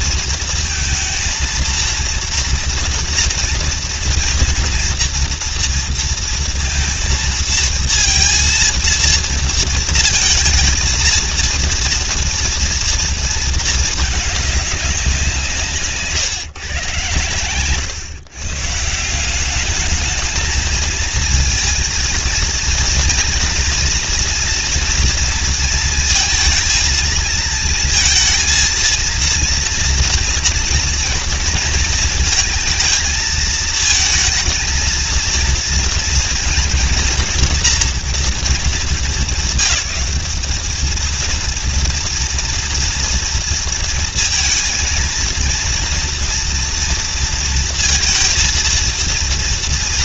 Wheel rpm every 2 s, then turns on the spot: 230, 230, 230, 230, 230, 220, 230, 200, 130, 140, 220, 230, 230, 230, 230, 230, 220, 230, 230, 220, 210, 230, 230, 230, 230.
none